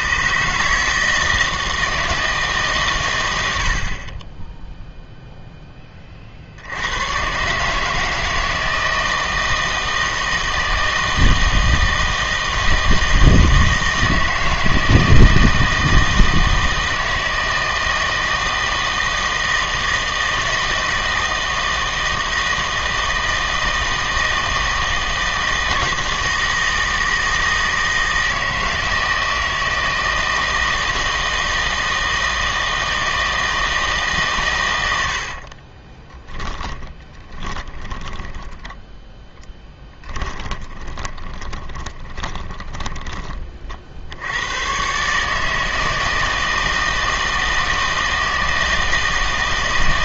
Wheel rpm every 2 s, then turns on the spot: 150, 140, 0, 70, 160, 160, 160, 160, 160, 160, 160, 160, 160, 160, 160, 160, 160, 100, 30, 10, 20, 20, 110, 160, 160.
36-44